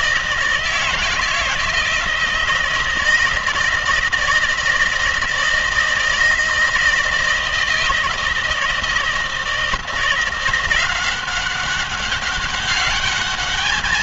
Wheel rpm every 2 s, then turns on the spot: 160, 160, 160, 160, 160, 180, 200.
none